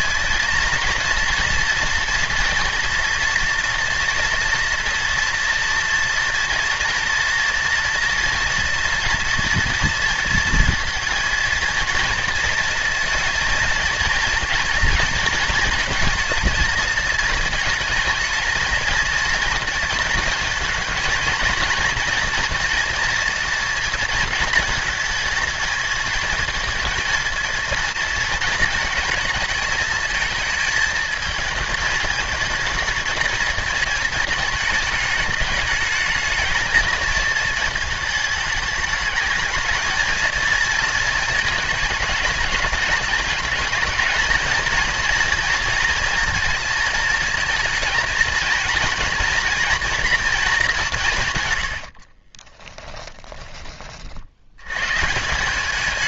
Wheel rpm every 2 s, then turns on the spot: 220, 240, 230, 230, 230, 230, 230, 230, 220, 230, 230, 240, 220, 230, 230, 220, 220, 210, 220, 220, 230, 210, 230, 230, 230, 200, 10, 120.
52-54